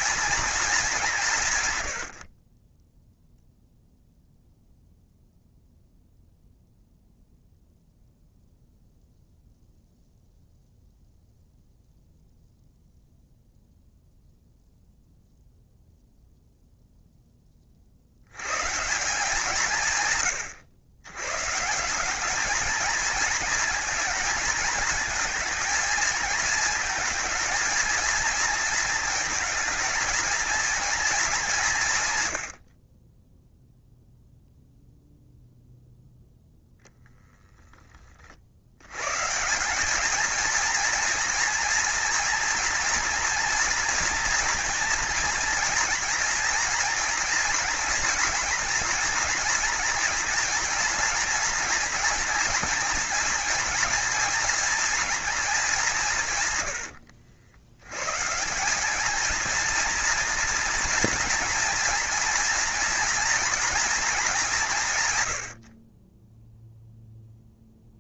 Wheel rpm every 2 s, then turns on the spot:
200, 10, 0, 0, 0, 0, 0, 0, 0, 160, 120, 220, 220, 220, 230, 220, 40, 0, 10, 100, 230, 240, 230, 240, 230, 230, 230, 230, 90, 200, 230, 240, 150, 0.
36-38